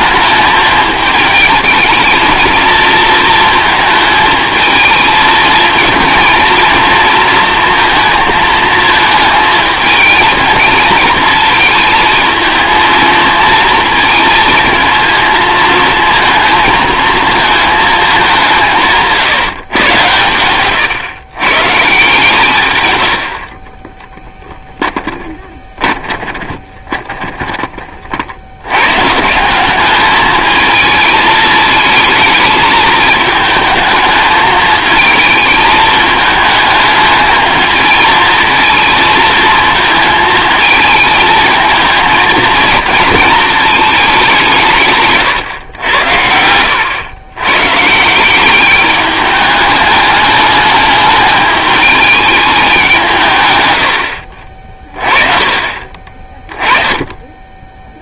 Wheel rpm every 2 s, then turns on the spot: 210, 230, 220, 230, 220, 230, 220, 230, 220, 170, 120, 120, 10, 30, 110, 220, 220, 220, 220, 220, 220, 230, 150, 90, 200, 210, 200, 40, 10.
24-28